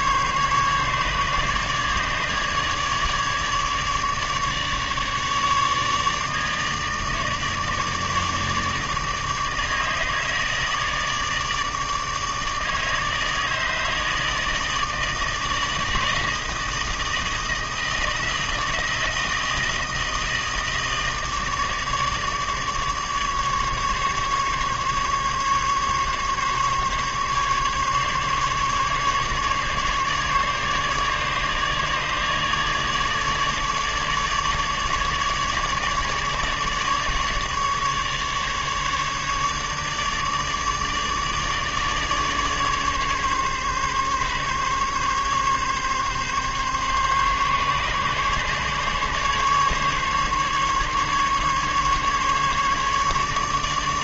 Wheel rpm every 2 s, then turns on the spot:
150, 150, 150, 150, 150, 160, 150, 160, 160, 160, 160, 150, 150, 140, 140, 150, 150, 150, 150, 150, 150, 150, 140, 140, 140, 140, 150.
none